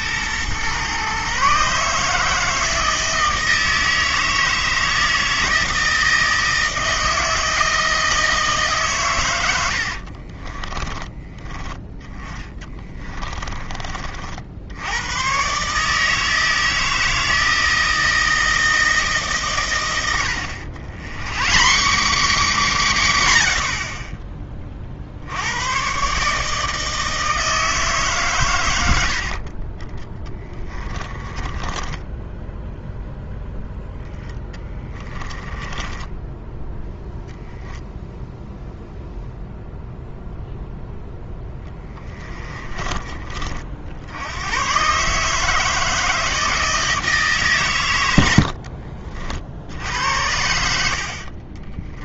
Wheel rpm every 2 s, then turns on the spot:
130, 160, 160, 160, 140, 20, 20, 80, 160, 160, 100, 220, 30, 160, 90, 20, 0, 10, 0, 0, 0, 20, 130, 160, 60, 70.
10-14 30-32 34-36 48-52